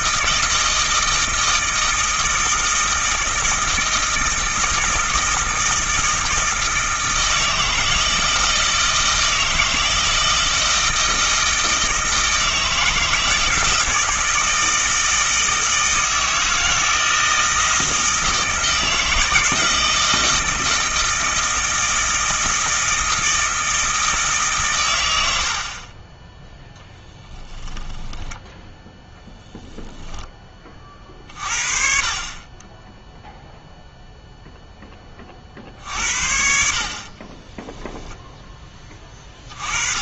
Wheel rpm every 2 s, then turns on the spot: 160, 160, 160, 160, 160, 160, 160, 160, 160, 160, 160, 160, 130, 10, 10, 30, 20, 10, 50, 10.
none